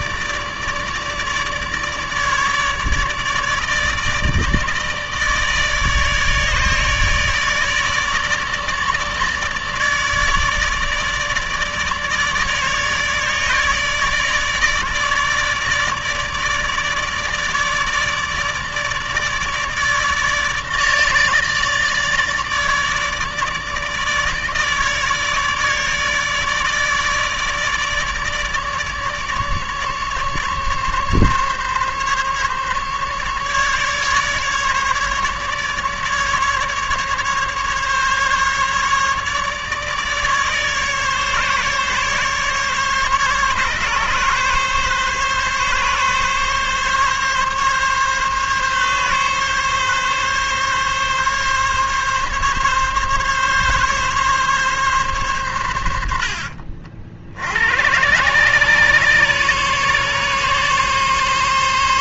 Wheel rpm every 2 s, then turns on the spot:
150, 150, 150, 150, 150, 150, 150, 150, 150, 150, 150, 150, 150, 150, 150, 140, 140, 150, 140, 150, 150, 140, 140, 140, 140, 140, 140, 140, 70, 140, 140.
none